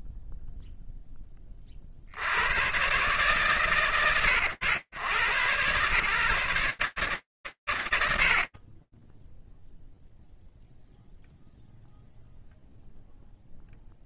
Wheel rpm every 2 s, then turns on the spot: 0, 110, 100, 120, 0, 0, 0.
none